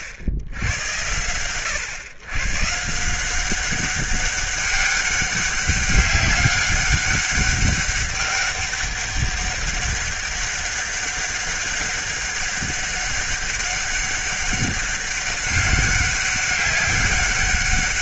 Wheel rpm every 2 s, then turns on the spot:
80, 140, 200, 200, 200, 200, 200, 200, 200.
none